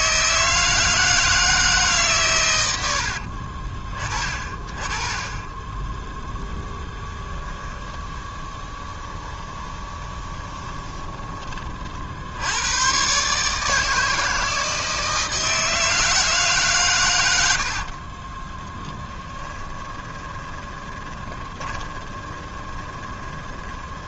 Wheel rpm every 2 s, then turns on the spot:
160, 120, 30, 10, 20, 20, 70, 160, 160, 30, 20, 20.
8-12 18-24